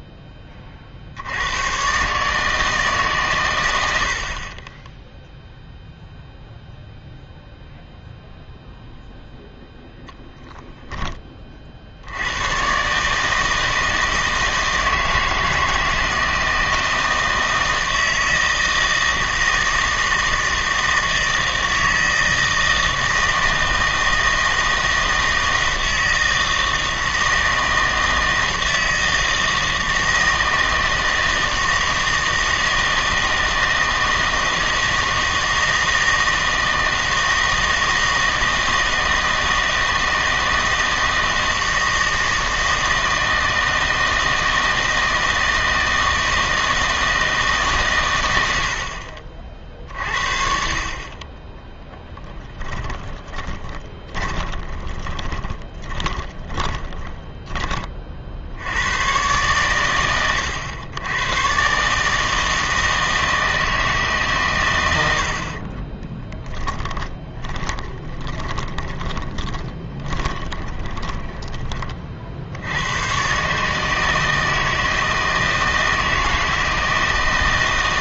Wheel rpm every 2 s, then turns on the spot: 20, 150, 30, 0, 0, 10, 110, 160, 160, 160, 160, 160, 160, 160, 160, 160, 160, 160, 160, 160, 160, 160, 160, 160, 80, 50, 10, 20, 20, 70, 100, 160, 120, 10, 20, 20, 70, 160, 160.
52-58 66-72